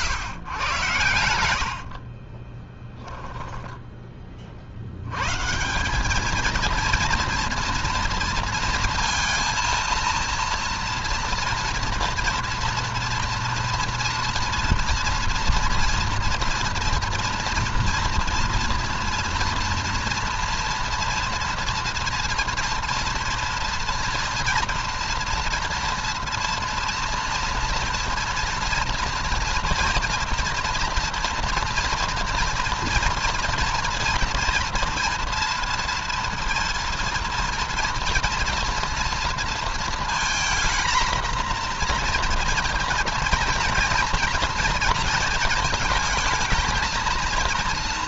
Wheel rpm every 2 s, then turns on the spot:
120, 10, 80, 230, 230, 230, 230, 230, 240, 230, 230, 230, 230, 230, 230, 240, 230, 230, 230, 230, 230, 230, 230, 220.
2-4